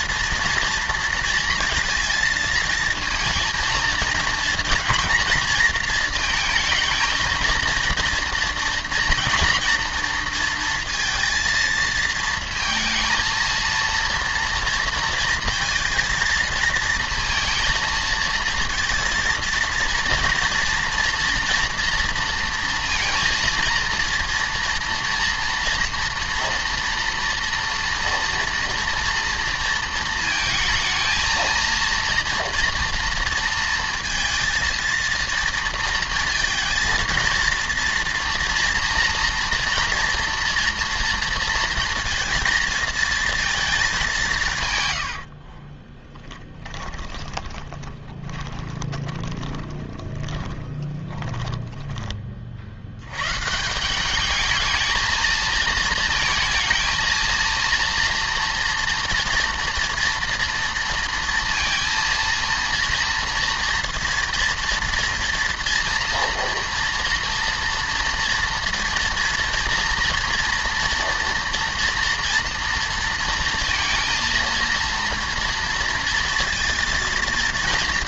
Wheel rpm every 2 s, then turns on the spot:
230, 230, 230, 220, 230, 230, 230, 230, 220, 230, 230, 230, 230, 230, 230, 230, 230, 230, 230, 230, 240, 230, 140, 10, 20, 20, 70, 220, 230, 230, 230, 230, 230, 230, 230, 230, 230, 230, 230.
46-52